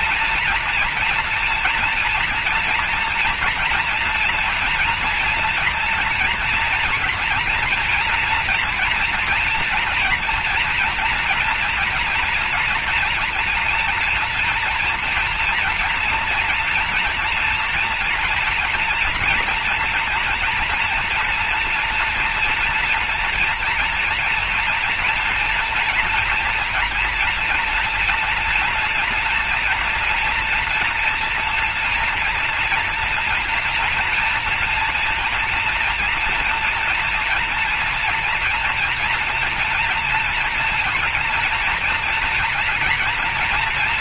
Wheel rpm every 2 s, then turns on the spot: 230, 230, 230, 230, 230, 230, 230, 230, 230, 230, 230, 240, 230, 240, 230, 240, 230, 230, 230, 230, 230, 230.
none